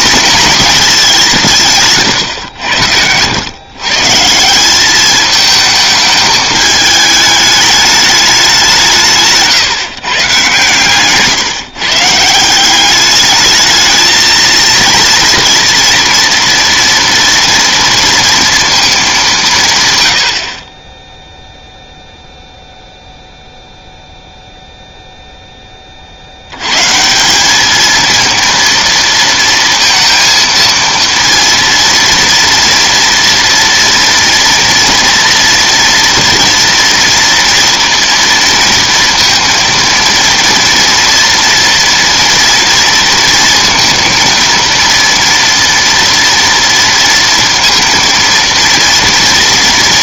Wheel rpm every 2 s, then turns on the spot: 220, 100, 190, 210, 170, 140, 190, 230, 230, 220, 30, 0, 0, 120, 230, 230, 230, 240, 230, 230, 230, 230, 230, 230, 230.
none